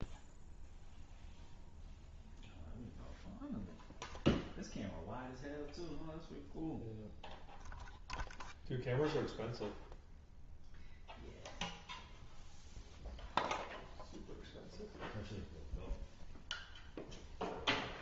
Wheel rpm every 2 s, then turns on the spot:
0, 0, 0, 0, 0, 0, 0, 0, 0.
none